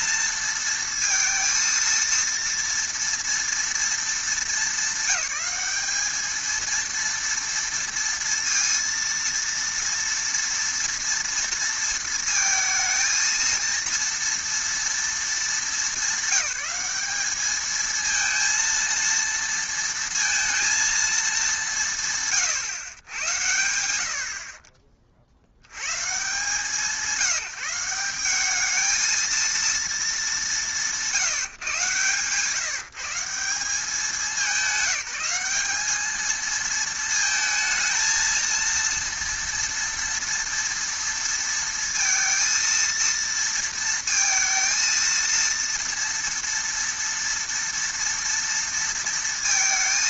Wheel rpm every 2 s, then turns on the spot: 230, 230, 220, 230, 230, 230, 220, 230, 210, 230, 230, 120, 40, 150, 210, 190, 160, 190, 220, 230, 230, 230, 230, 230, 230.
none